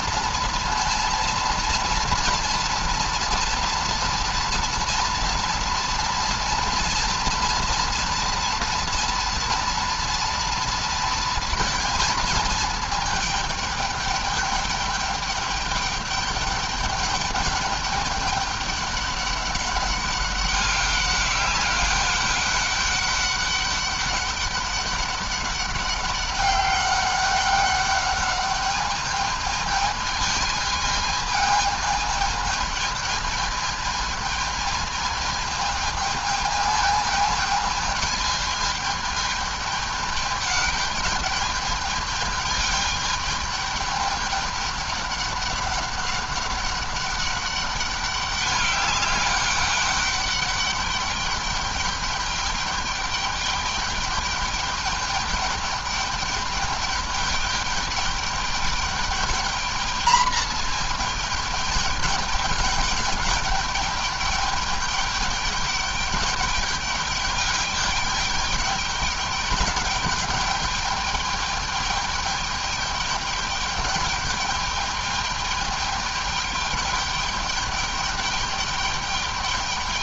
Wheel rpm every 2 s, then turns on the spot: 230, 230, 230, 230, 230, 230, 220, 210, 210, 200, 200, 200, 200, 200, 210, 220, 220, 220, 220, 220, 210, 210, 210, 200, 200, 200, 210, 210, 210, 210, 220, 210, 210, 210, 210, 210, 210, 210, 210, 210.
none